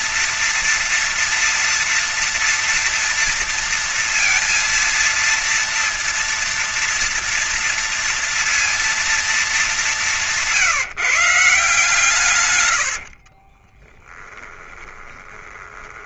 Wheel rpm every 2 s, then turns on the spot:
230, 230, 230, 230, 230, 170, 120, 10.
12-16